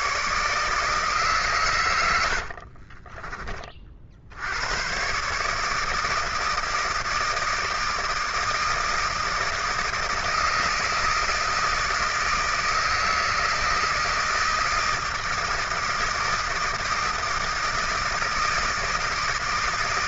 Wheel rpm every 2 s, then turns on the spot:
130, 80, 60, 160, 160, 160, 160, 160, 160, 160.
2-4